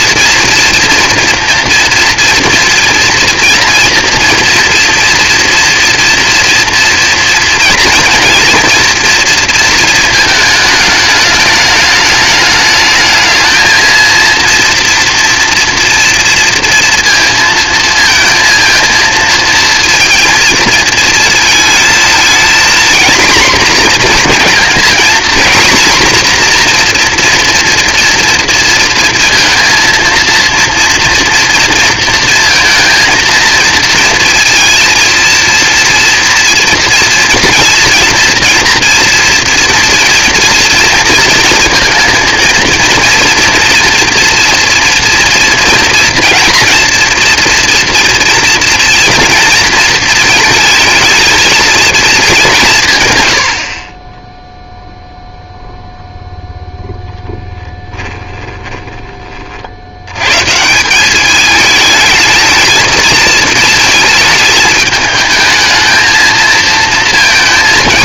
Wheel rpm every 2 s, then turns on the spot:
240, 230, 230, 230, 230, 220, 210, 230, 230, 230, 230, 240, 230, 240, 230, 230, 230, 230, 230, 240, 230, 230, 230, 230, 230, 220, 170, 0, 0, 10, 160, 220, 220, 220.
58-60